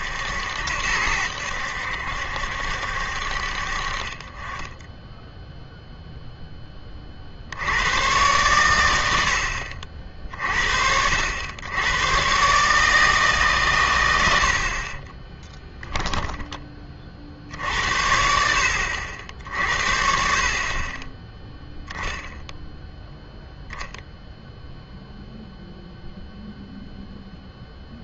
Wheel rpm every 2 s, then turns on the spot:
80, 70, 20, 10, 100, 60, 150, 50, 20, 80, 30, 0, 0, 0.
none